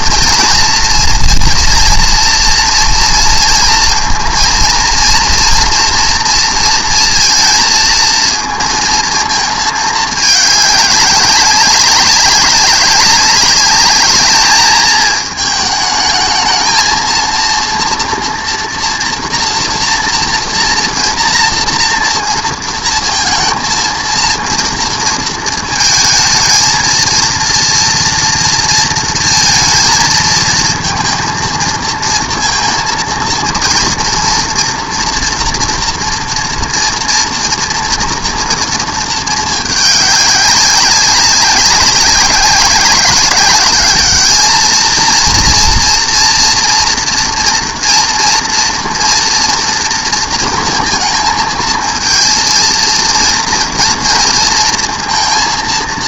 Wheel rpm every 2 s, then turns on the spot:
240, 230, 230, 230, 230, 210, 200, 210, 220, 230, 230, 230, 230, 220, 230, 220, 230, 230, 230, 230, 190, 200, 220, 230, 230, 230, 230, 230.
none